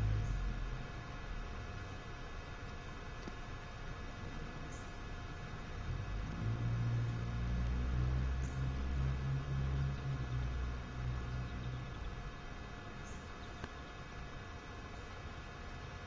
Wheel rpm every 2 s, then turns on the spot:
0, 0, 0, 0, 0, 0, 0, 0.
none